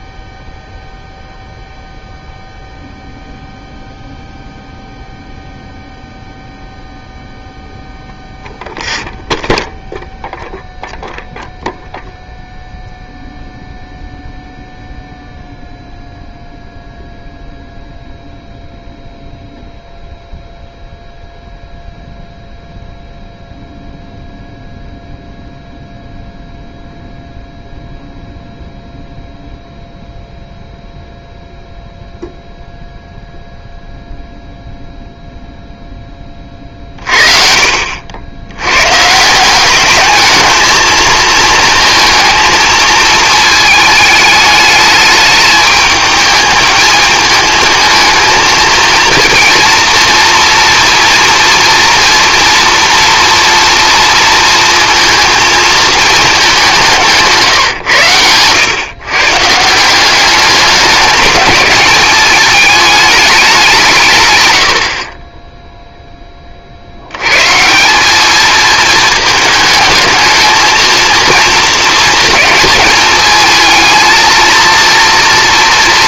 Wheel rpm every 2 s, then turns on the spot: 0, 0, 0, 0, 0, 0, 0, 0, 0, 0, 0, 0, 0, 0, 0, 0, 0, 0, 50, 120, 220, 220, 210, 220, 230, 230, 230, 230, 180, 120, 200, 210, 70, 50, 220, 230, 220, 230.
none